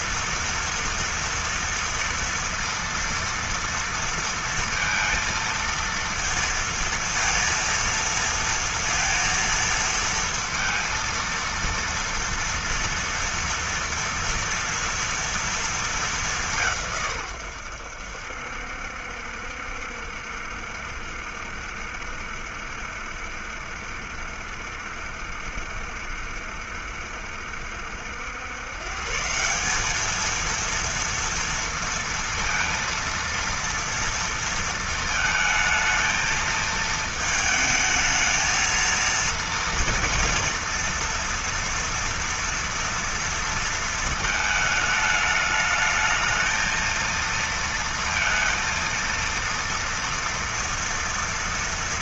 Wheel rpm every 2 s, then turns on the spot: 230, 230, 230, 230, 230, 230, 230, 230, 180, 70, 70, 70, 70, 70, 110, 220, 230, 230, 220, 220, 230, 230, 220, 220, 230, 230.
none